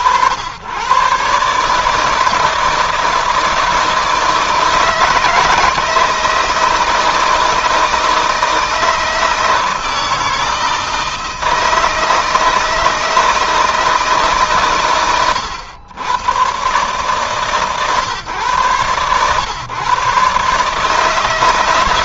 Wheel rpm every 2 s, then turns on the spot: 120, 160, 160, 160, 160, 160, 160, 130, 140, 120, 150.
none